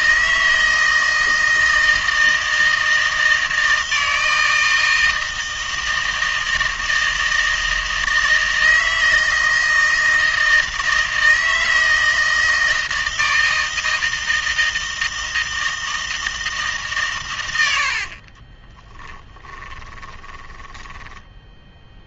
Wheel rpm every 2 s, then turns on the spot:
160, 160, 160, 160, 160, 160, 160, 160, 160, 20, 10.
18-22